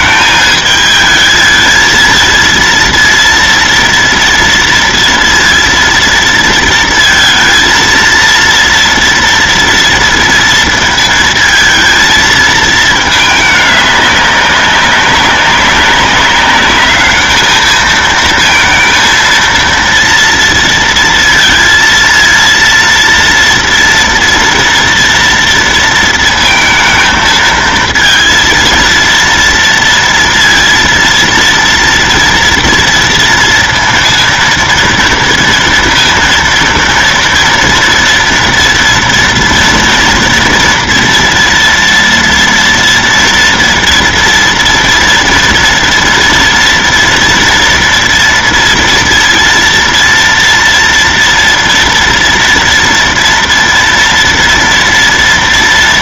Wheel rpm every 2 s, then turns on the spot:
220, 230, 230, 230, 230, 230, 220, 200, 200, 230, 230, 230, 230, 230, 230, 230, 230, 230, 230, 230, 230, 230, 230, 230, 230, 230, 230, 230.
none